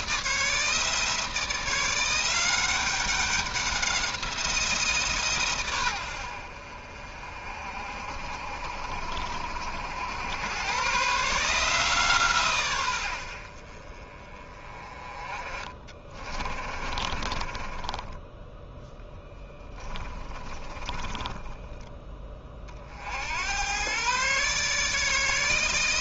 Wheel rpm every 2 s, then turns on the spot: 160, 190, 170, 60, 60, 120, 120, 30, 30, 10, 20, 40, 150.
16-18 20-22